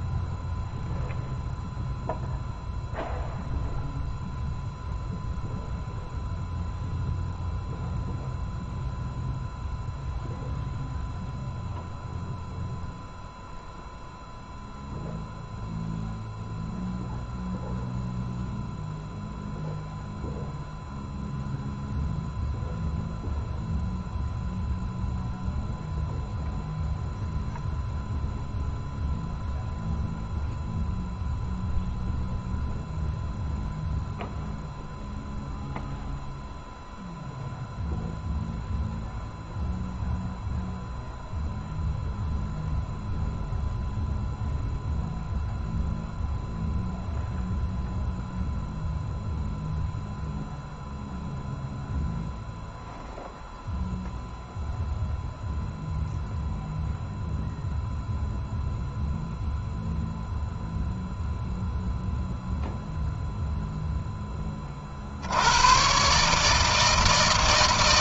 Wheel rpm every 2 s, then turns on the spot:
0, 0, 0, 0, 0, 0, 0, 0, 0, 0, 0, 0, 0, 0, 0, 0, 0, 0, 0, 0, 0, 0, 0, 0, 0, 0, 0, 0, 0, 0, 0, 0, 10, 140.
none